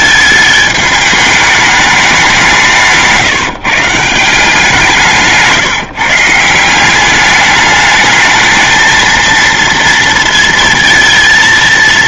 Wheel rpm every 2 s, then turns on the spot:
220, 180, 170, 170, 220, 230.
none